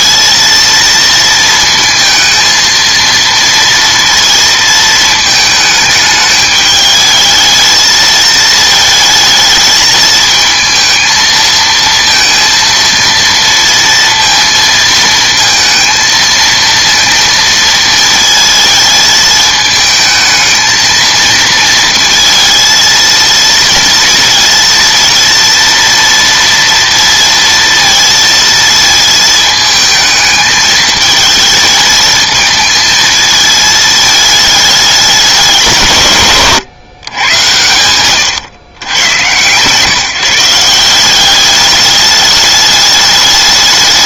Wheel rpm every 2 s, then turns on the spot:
230, 230, 230, 220, 220, 220, 230, 230, 230, 220, 220, 230, 230, 230, 220, 220, 220, 210, 140, 120, 180, 210.
none